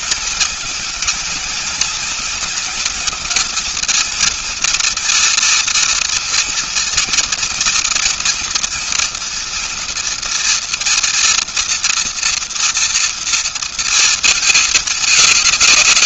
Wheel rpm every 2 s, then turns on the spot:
220, 220, 230, 230, 230, 230, 230, 210.
none